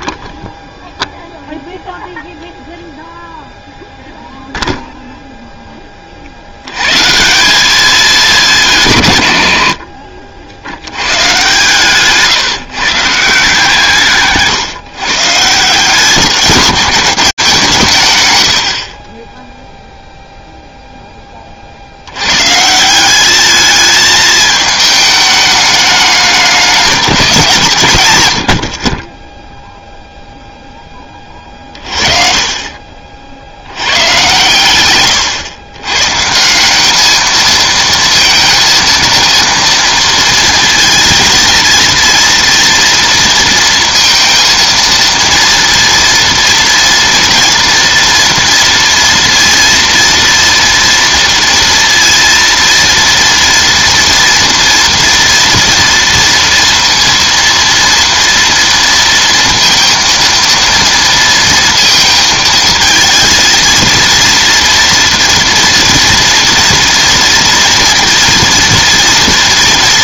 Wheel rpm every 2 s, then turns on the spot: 0, 0, 0, 110, 180, 100, 160, 140, 200, 50, 0, 140, 220, 200, 50, 20, 40, 120, 210, 230, 230, 230, 230, 230, 230, 230, 230, 230, 230, 230, 230, 230, 230, 230, 230.
none